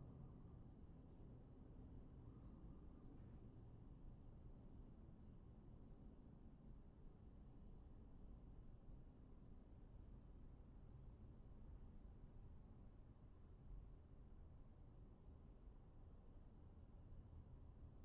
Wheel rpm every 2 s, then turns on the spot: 0, 0, 0, 0, 0, 0, 0, 0, 0.
none